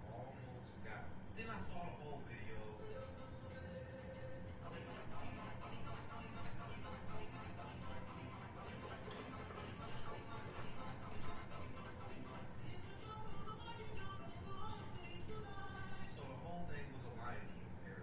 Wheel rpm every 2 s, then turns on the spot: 0, 0, 0, 0, 0, 0, 0, 0, 0.
none